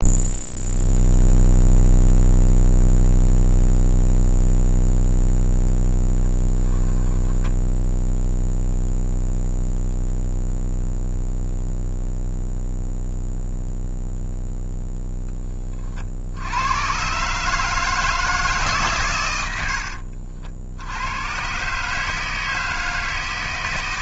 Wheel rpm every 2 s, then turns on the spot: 0, 0, 0, 10, 0, 0, 0, 0, 110, 130, 80, 160.
none